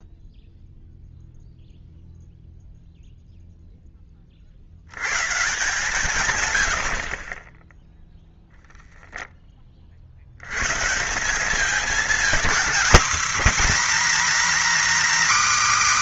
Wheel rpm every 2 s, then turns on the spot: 0, 0, 70, 70, 0, 130, 260, 300.
none